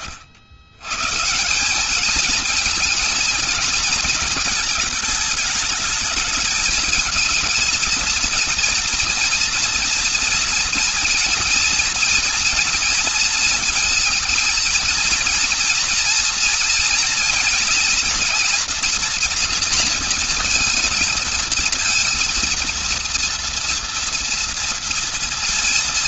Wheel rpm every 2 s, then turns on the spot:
80, 220, 220, 220, 230, 230, 240, 230, 230, 230, 220, 230, 230.
none